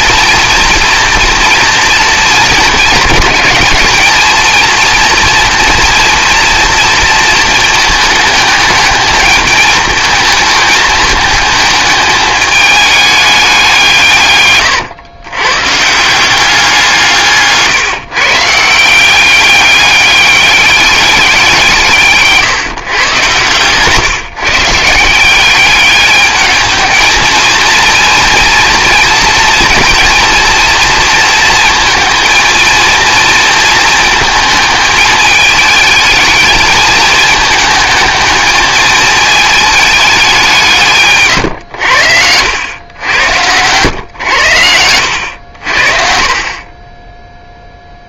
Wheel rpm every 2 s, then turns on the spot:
230, 220, 230, 230, 210, 220, 210, 120, 180, 170, 200, 140, 140, 210, 220, 230, 230, 220, 220, 220, 160, 100, 90, 20.
none